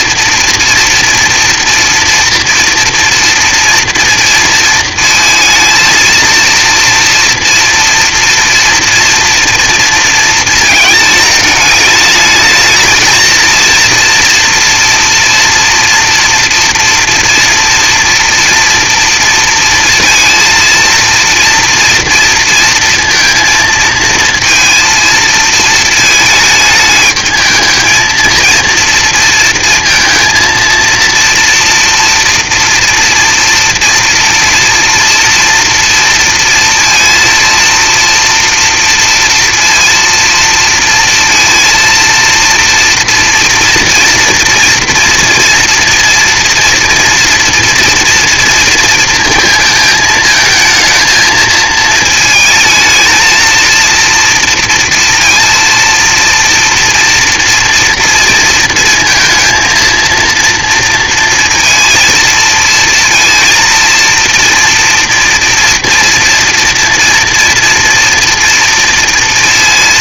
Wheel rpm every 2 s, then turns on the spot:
230, 230, 230, 230, 240, 230, 220, 230, 240, 230, 230, 230, 230, 210, 230, 230, 230, 230, 230, 230, 220, 230, 230, 240, 230, 220, 220, 230, 230, 230, 230, 230, 230, 230, 230.
none